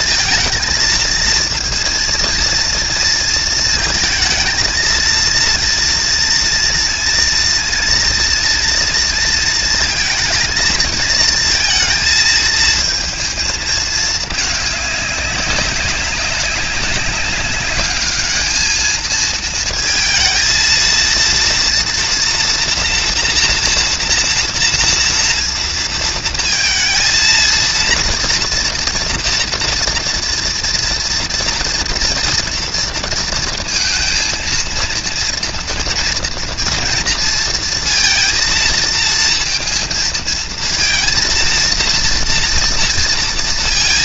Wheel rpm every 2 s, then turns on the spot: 230, 230, 230, 230, 230, 220, 230, 200, 200, 220, 230, 230, 230, 230, 230, 230, 230, 230, 230, 230, 230, 230.
none